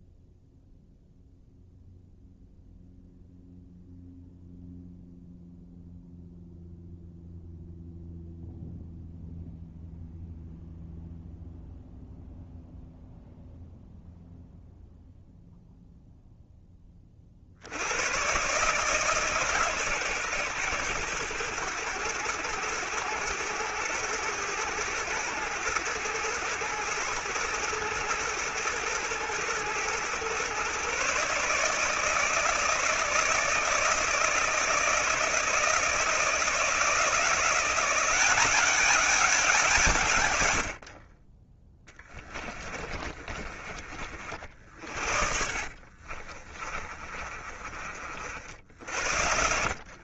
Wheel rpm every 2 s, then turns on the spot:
0, 0, 0, 0, 0, 0, 0, 0, 20, 140, 110, 110, 110, 110, 110, 130, 160, 160, 160, 200, 60, 30, 50, 30, 70.
42-50